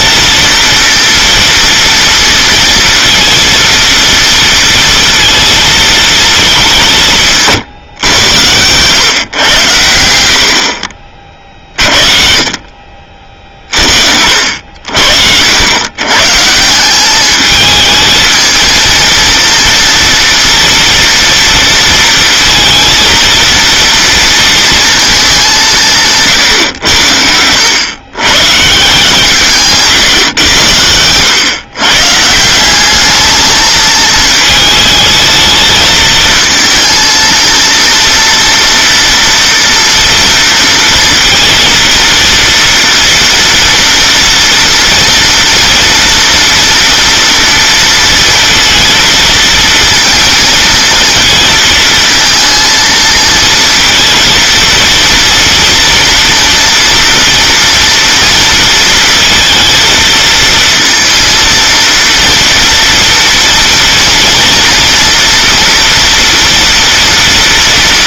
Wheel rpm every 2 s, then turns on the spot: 230, 230, 230, 210, 100, 60, 50, 70, 160, 230, 230, 230, 230, 120, 140, 100, 180, 220, 220, 230, 230, 240, 230, 230, 230, 230, 230, 230, 230, 230, 230, 230, 230, 230.
none